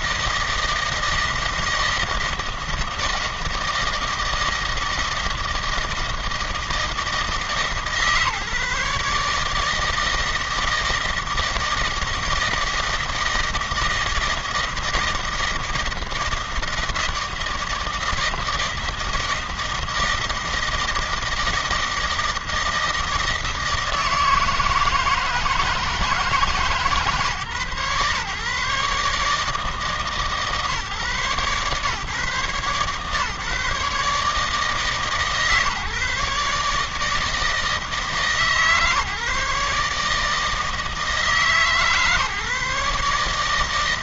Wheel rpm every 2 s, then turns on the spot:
160, 160, 160, 160, 150, 160, 160, 160, 160, 160, 160, 160, 160, 150, 140, 140, 130, 150, 150, 150, 150, 140.
none